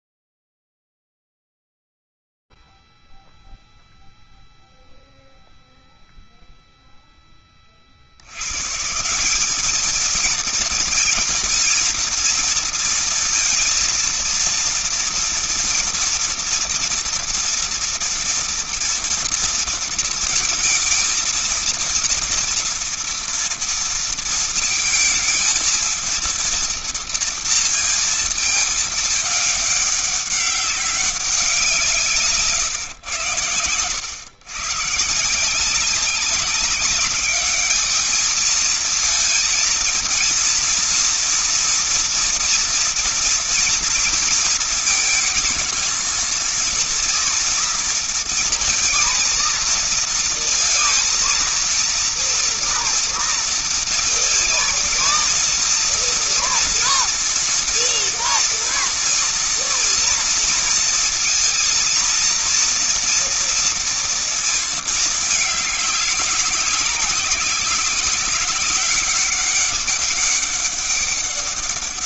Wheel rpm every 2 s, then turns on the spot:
0, 0, 0, 0, 60, 210, 230, 230, 230, 230, 230, 230, 230, 230, 230, 200, 170, 110, 190, 210, 230, 240, 230, 220, 230, 230, 230, 230, 230, 230, 230, 230, 230, 200, 200, 200.
none